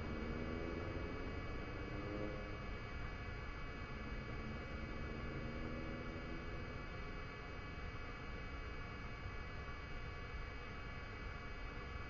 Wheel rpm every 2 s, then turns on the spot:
0, 0, 0, 0, 0, 0.
none